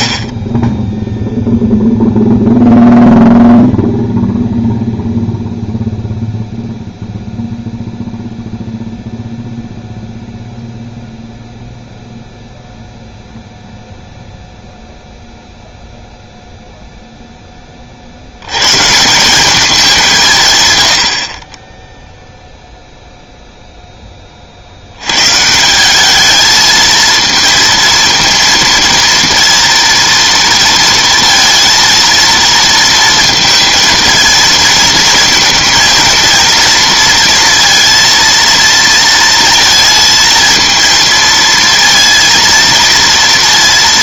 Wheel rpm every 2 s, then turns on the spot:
30, 0, 0, 0, 0, 0, 0, 0, 0, 110, 120, 0, 50, 220, 230, 230, 230, 220, 230, 230, 230, 230.
none